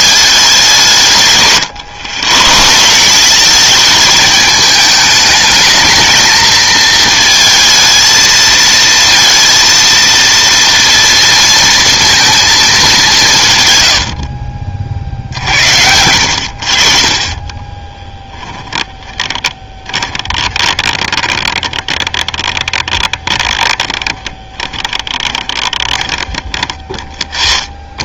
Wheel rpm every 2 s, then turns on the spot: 180, 150, 210, 220, 230, 230, 210, 60, 60, 20, 20, 20, 10, 20.
18-26